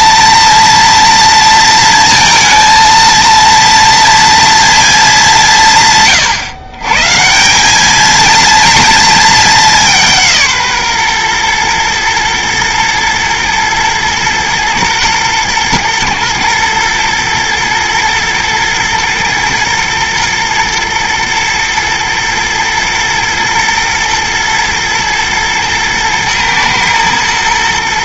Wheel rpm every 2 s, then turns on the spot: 230, 230, 230, 130, 230, 140, 120, 120, 120, 110, 120, 110, 120, 110.
none